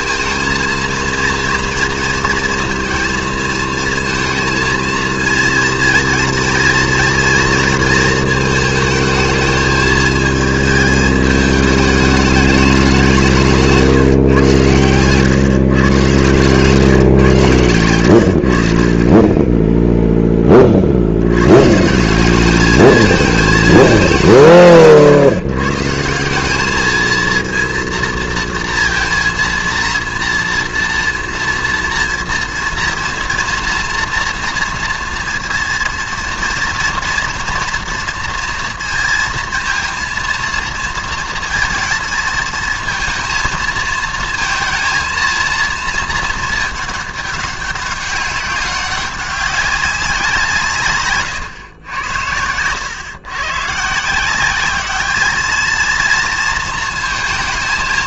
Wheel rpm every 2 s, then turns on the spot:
230, 230, 230, 230, 220, 220, 200, 120, 130, 50, 40, 210, 150, 210, 230, 230, 230, 230, 230, 230, 230, 220, 230, 210, 200, 170, 110, 200, 220.
none